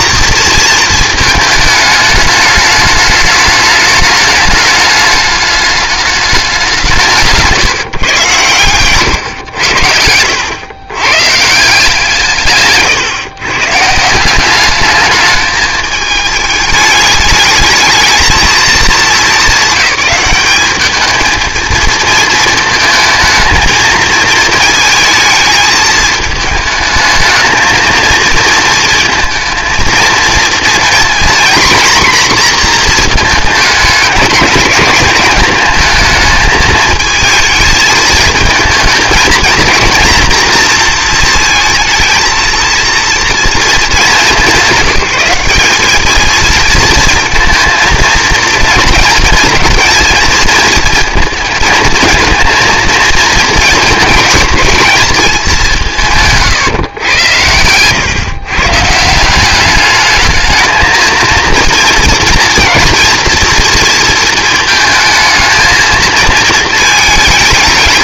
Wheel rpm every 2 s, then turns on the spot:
230, 210, 210, 190, 120, 100, 140, 200, 210, 220, 210, 220, 220, 210, 230, 230, 240, 210, 220, 220, 240, 230, 190, 220, 230, 230, 230, 220, 130, 150, 220, 230, 220, 220.
none